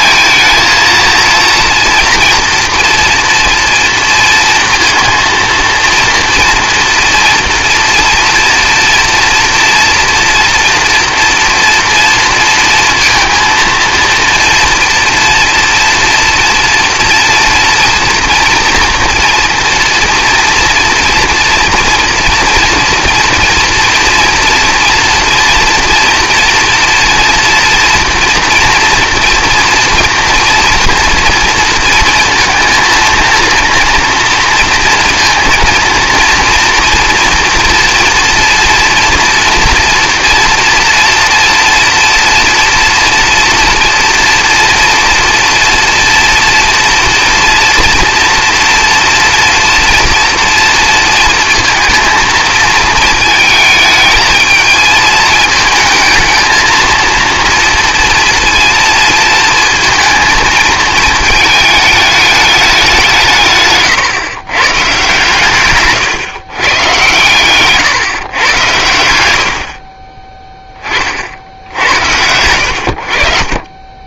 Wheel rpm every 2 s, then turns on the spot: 220, 230, 230, 230, 240, 240, 230, 230, 230, 230, 230, 230, 230, 230, 240, 240, 230, 230, 230, 230, 240, 230, 230, 230, 240, 230, 230, 220, 220, 230, 230, 210, 120, 140, 130, 20, 80.
none